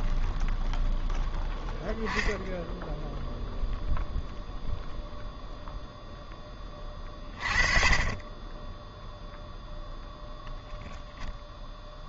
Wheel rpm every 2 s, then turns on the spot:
0, 0, 0, 20, 10, 0.
none